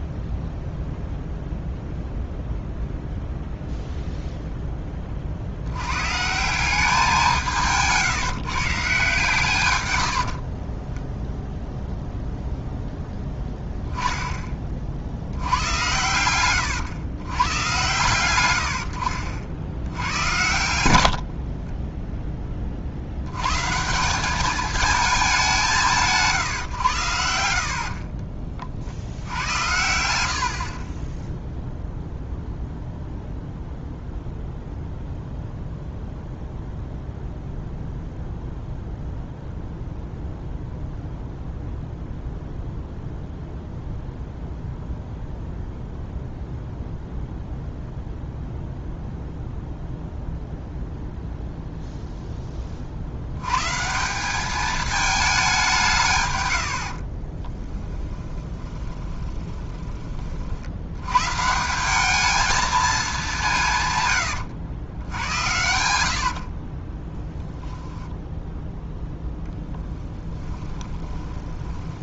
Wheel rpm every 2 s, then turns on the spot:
0, 0, 10, 180, 160, 40, 0, 30, 110, 90, 90, 40, 220, 120, 50, 50, 0, 0, 0, 0, 0, 0, 0, 0, 0, 0, 30, 210, 90, 20, 70, 220, 100, 50, 0, 20.
10-12 56-60 66-68 70-72